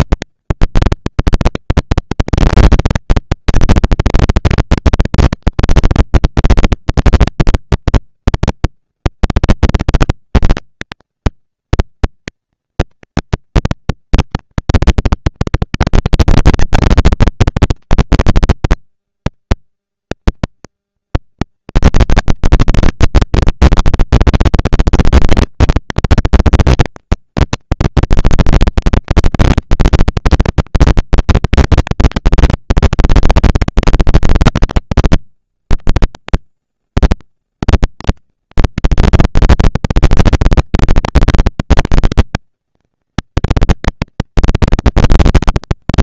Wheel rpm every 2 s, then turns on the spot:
230, 240, 230, 230, 230, 230, 230, 230, 230, 230, 240, 230, 230, 230, 230, 230, 210, 170, 100, 210, 230, 230, 230.
none